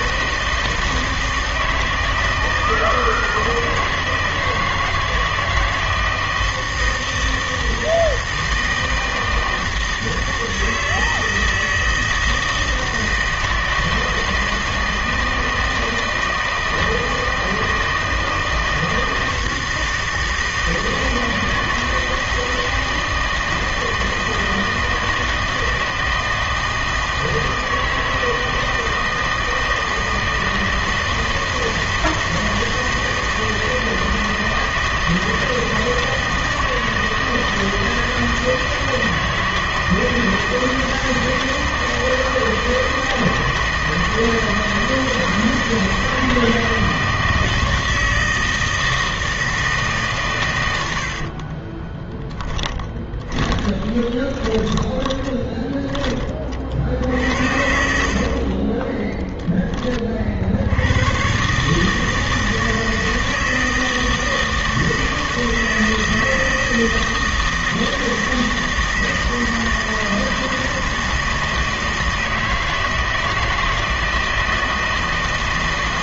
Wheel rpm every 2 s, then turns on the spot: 160, 160, 160, 160, 160, 160, 160, 160, 160, 160, 160, 160, 160, 160, 160, 160, 160, 160, 160, 160, 160, 160, 160, 160, 160, 130, 10, 20, 40, 50, 50, 160, 160, 160, 160, 160, 160, 160.
52-56